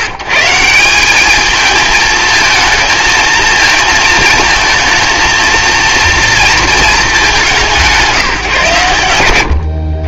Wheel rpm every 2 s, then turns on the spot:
150, 230, 230, 210, 120.
none